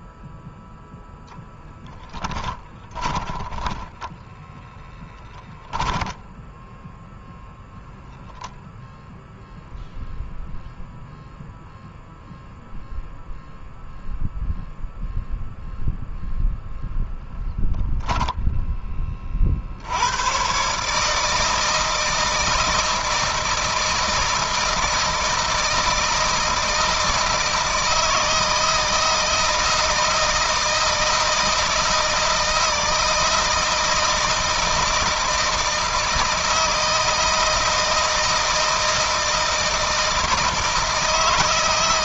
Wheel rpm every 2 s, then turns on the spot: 0, 10, 10, 10, 0, 0, 0, 0, 0, 10, 130, 160, 160, 160, 160, 160, 160, 160, 160, 160, 160.
2-8